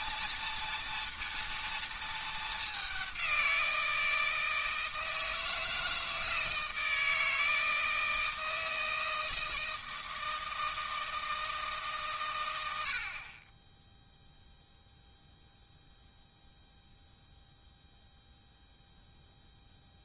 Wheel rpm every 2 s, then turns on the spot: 230, 200, 160, 160, 160, 160, 80, 0, 0, 0.
none